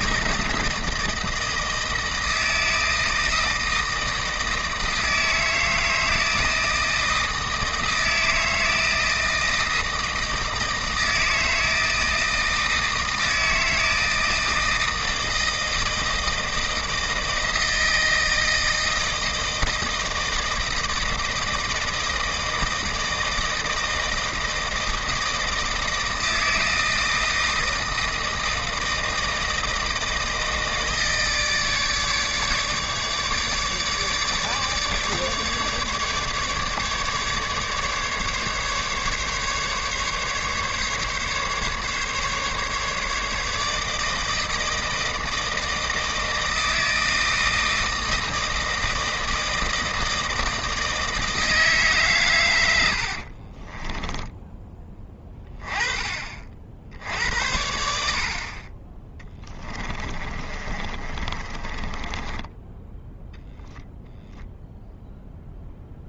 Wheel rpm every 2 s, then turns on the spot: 160, 160, 160, 160, 160, 160, 160, 160, 160, 160, 160, 170, 160, 160, 160, 160, 150, 150, 150, 140, 150, 150, 160, 160, 160, 160, 90, 10, 60, 30, 30, 10, 0.
60-64